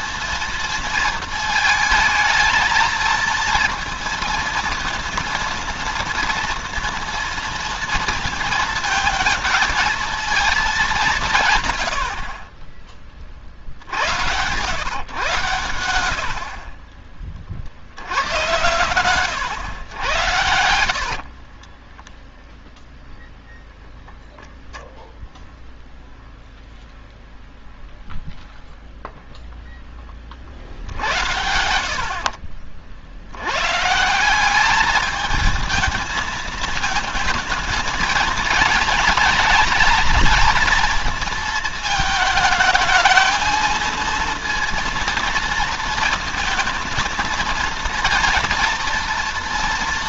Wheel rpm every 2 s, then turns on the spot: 230, 220, 230, 240, 220, 210, 40, 110, 50, 100, 70, 0, 0, 0, 0, 50, 50, 200, 220, 220, 230, 220, 230, 220, 230.
12-14 20-22